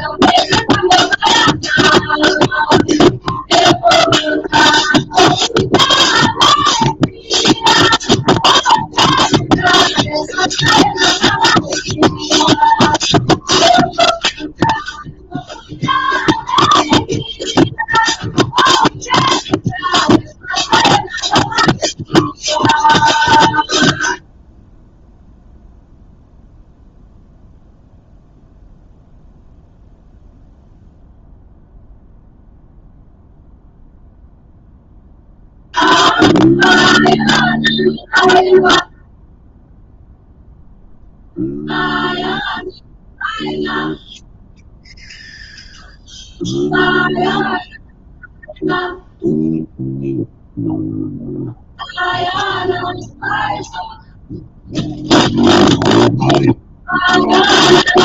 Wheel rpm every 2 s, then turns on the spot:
0, 0, 0, 0, 0, 0, 0, 0, 0, 0, 0, 0, 0, 0, 0, 0, 0, 0, 0, 0, 0, 0, 0, 0, 0, 0, 0, 0, 0.
none